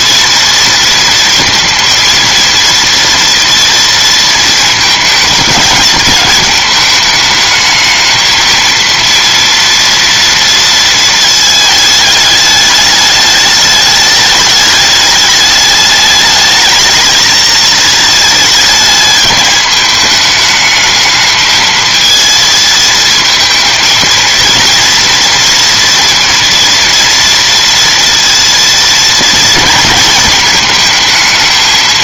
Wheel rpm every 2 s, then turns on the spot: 230, 230, 230, 220, 230, 230, 210, 210, 220, 220, 210, 220, 230, 230, 230, 220.
none